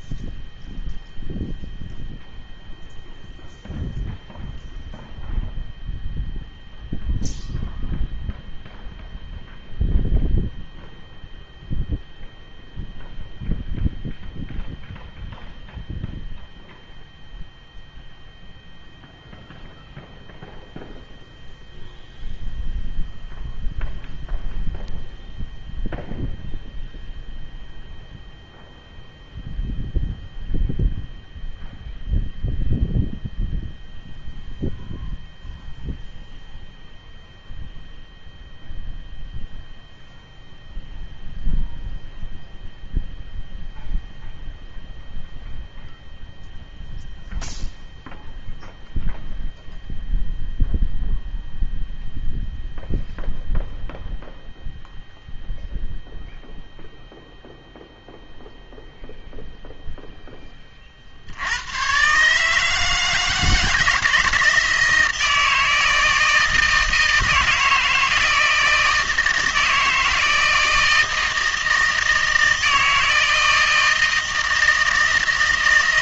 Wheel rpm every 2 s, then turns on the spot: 0, 0, 0, 0, 0, 0, 0, 0, 0, 0, 0, 0, 0, 0, 0, 0, 0, 0, 0, 0, 0, 0, 0, 0, 0, 0, 0, 0, 0, 0, 20, 160, 160, 160, 160, 160, 160, 160.
none